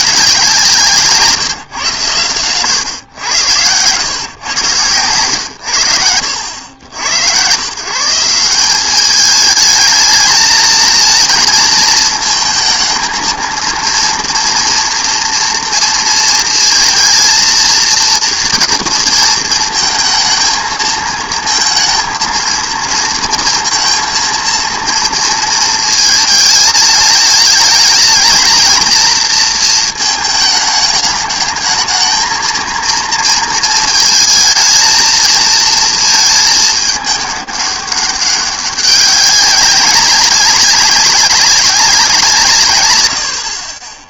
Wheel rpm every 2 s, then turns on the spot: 170, 110, 120, 80, 180, 220, 230, 230, 230, 230, 230, 230, 230, 220, 230, 220, 230, 230, 210, 200, 200, 130.
none